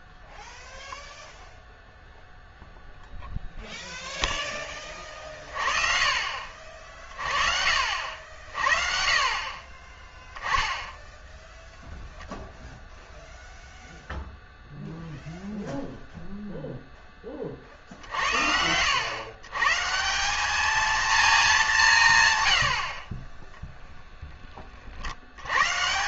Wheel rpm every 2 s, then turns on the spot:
0, 0, 20, 40, 40, 10, 0, 0, 0, 100, 220, 70, 40.
none